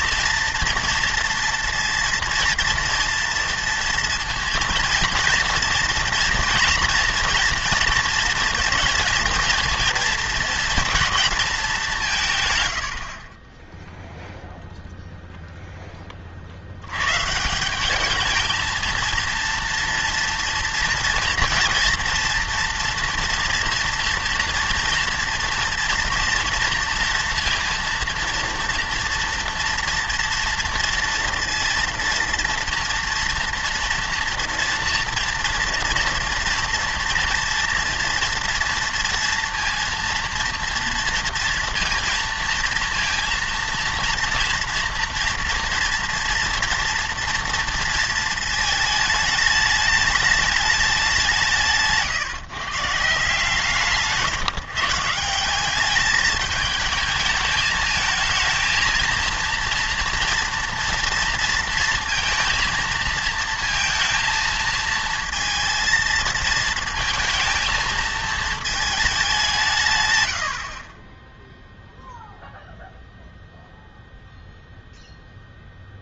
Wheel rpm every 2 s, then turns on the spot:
230, 230, 230, 240, 230, 220, 110, 0, 70, 220, 240, 240, 230, 230, 230, 230, 230, 240, 240, 230, 230, 230, 230, 230, 220, 210, 150, 150, 210, 220, 230, 230, 230, 220, 220, 50, 0, 0.
none